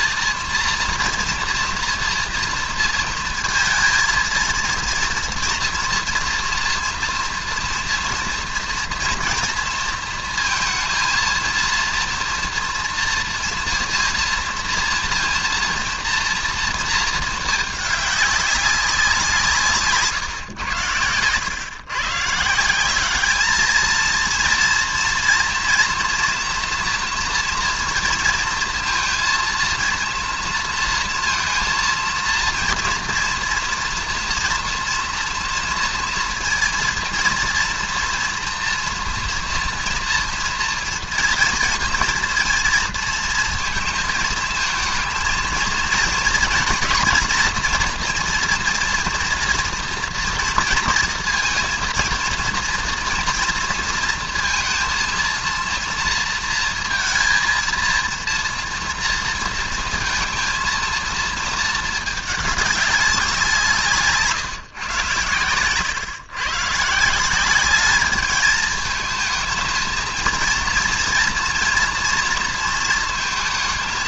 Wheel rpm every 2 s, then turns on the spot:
230, 230, 230, 230, 230, 230, 230, 230, 230, 200, 120, 170, 230, 230, 230, 230, 230, 230, 230, 230, 230, 230, 230, 230, 240, 230, 230, 230, 230, 230, 230, 210, 150, 140, 220, 230, 230.
none